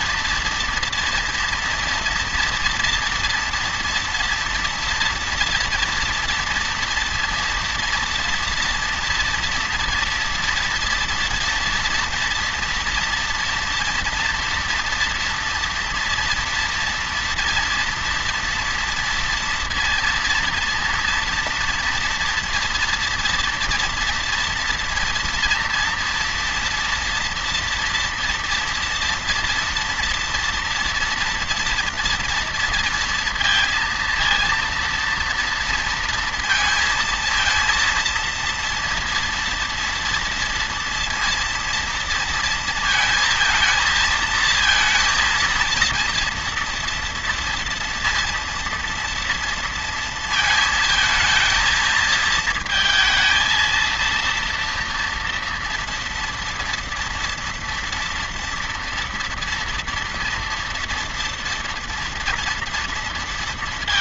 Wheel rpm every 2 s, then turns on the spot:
230, 230, 230, 230, 230, 230, 230, 230, 230, 230, 230, 230, 240, 230, 230, 240, 230, 230, 230, 230, 230, 230, 230, 230, 230, 220, 220, 230, 230, 230, 240, 230.
none